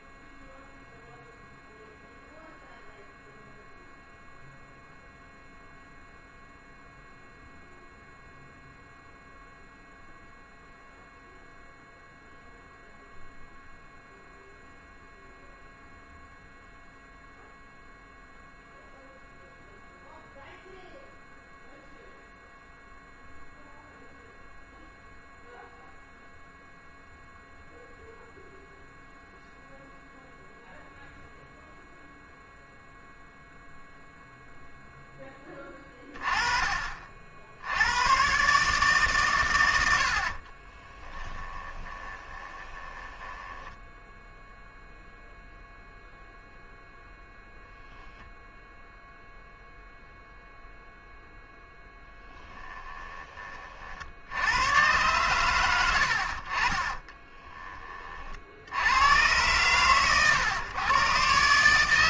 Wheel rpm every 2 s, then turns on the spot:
0, 0, 0, 0, 0, 0, 0, 0, 0, 0, 0, 0, 0, 0, 0, 0, 0, 0, 30, 140, 40, 20, 0, 0, 0, 0, 10, 100, 40, 70, 120.
40-44